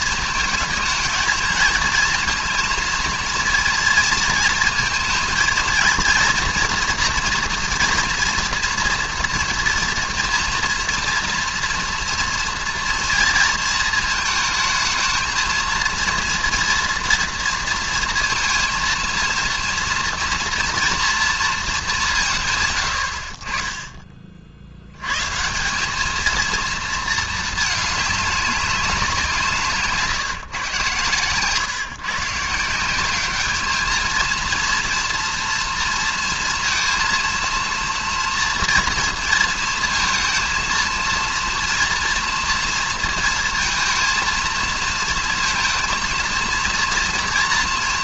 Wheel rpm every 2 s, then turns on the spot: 220, 230, 230, 240, 230, 230, 230, 220, 230, 230, 230, 120, 80, 230, 200, 120, 170, 230, 230, 230, 230, 230, 230, 230.
none